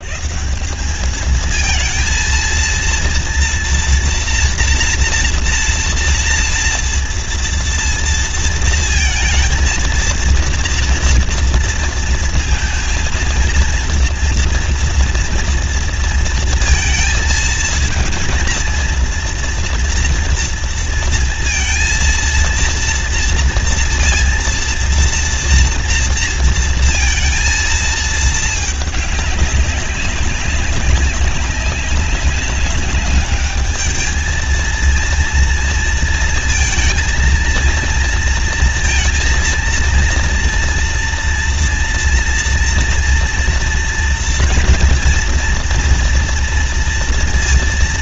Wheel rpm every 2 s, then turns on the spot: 180, 230, 230, 230, 230, 230, 230, 230, 230, 230, 230, 230, 230, 230, 210, 190, 200, 230, 220, 230, 230, 230, 240, 240.
none